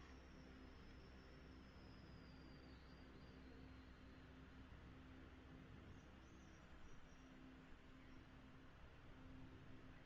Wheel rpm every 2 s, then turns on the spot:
0, 0, 0, 0, 0.
none